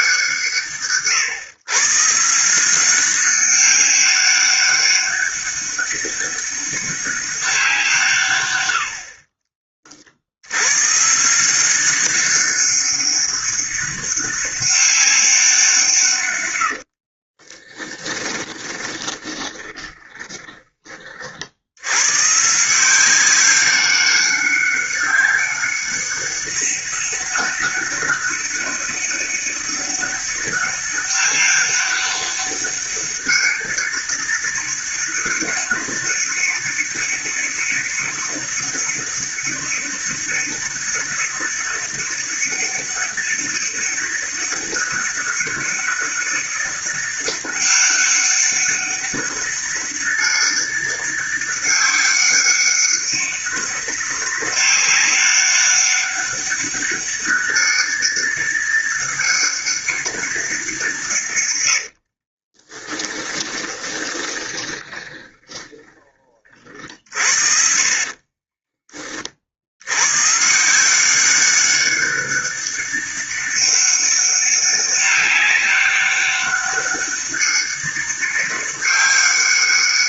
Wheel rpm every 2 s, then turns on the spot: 150, 190, 200, 200, 60, 140, 200, 200, 50, 20, 40, 180, 200, 200, 200, 200, 200, 200, 200, 200, 200, 200, 200, 200, 200, 200, 200, 200, 200, 200, 150, 20, 20, 50, 30, 180, 200, 200, 200, 200.
16-20 62-66